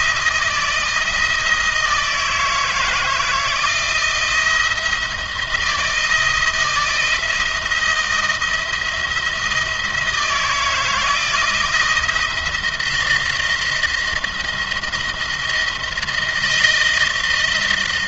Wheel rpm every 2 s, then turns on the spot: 170, 160, 170, 160, 160, 160, 170, 170, 160.
none